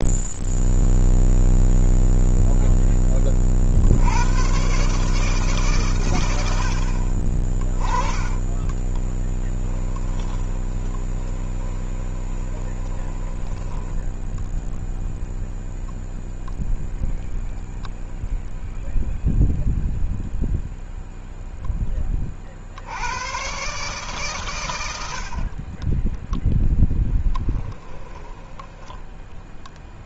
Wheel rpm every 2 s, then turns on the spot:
0, 10, 130, 70, 20, 10, 20, 0, 0, 0, 0, 70, 100, 0, 10.
8-14